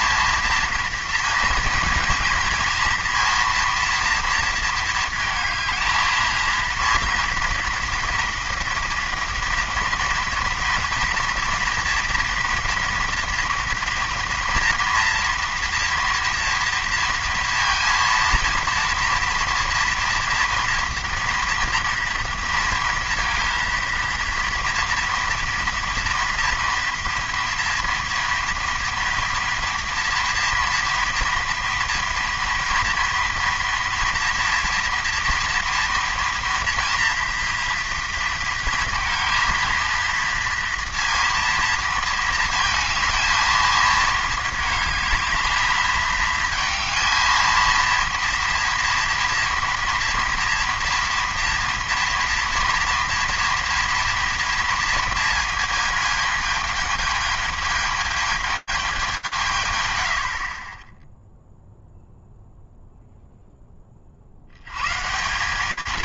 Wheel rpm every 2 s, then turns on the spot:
230, 230, 220, 230, 230, 230, 230, 240, 230, 230, 240, 230, 230, 240, 240, 230, 230, 230, 230, 230, 230, 220, 220, 220, 230, 230, 230, 230, 210, 160, 0, 0, 180.
none